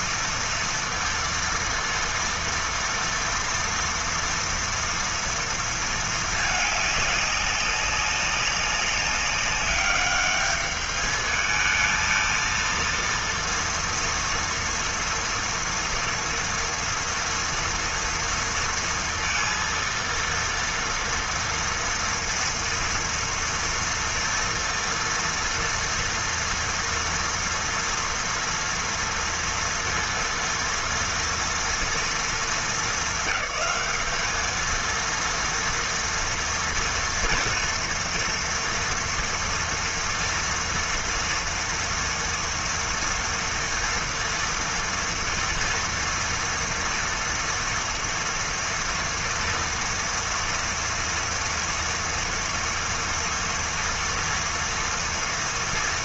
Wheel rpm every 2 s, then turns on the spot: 230, 230, 230, 210, 200, 210, 230, 240, 230, 230, 230, 230, 230, 230, 230, 230, 220, 220, 230, 230, 230, 230, 230, 230, 230, 230, 230, 230.
none